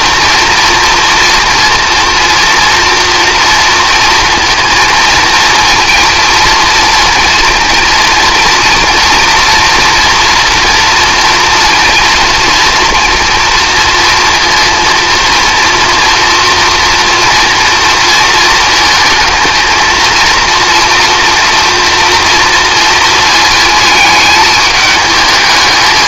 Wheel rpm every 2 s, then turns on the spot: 230, 230, 230, 230, 230, 230, 230, 230, 230, 230, 230, 230, 210.
none